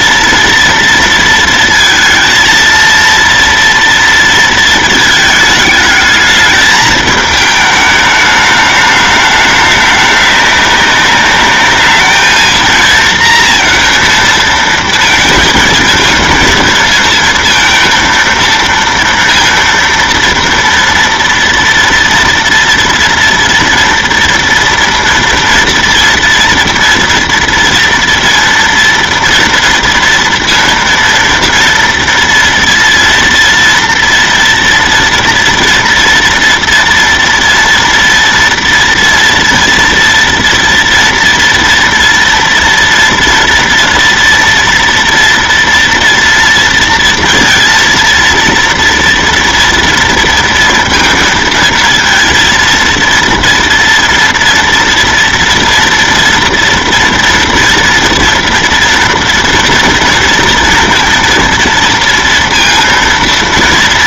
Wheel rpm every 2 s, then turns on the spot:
230, 230, 230, 220, 210, 200, 220, 230, 230, 230, 230, 240, 230, 230, 230, 230, 230, 240, 240, 240, 230, 230, 230, 230, 230, 230, 230, 230, 230, 230, 230, 230.
none